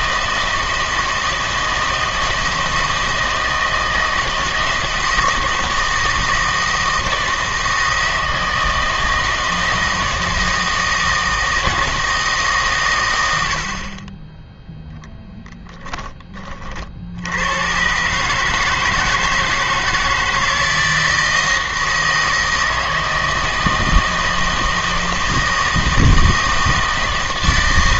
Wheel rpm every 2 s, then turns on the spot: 160, 160, 160, 160, 160, 160, 140, 0, 50, 150, 160, 160, 160, 160.
none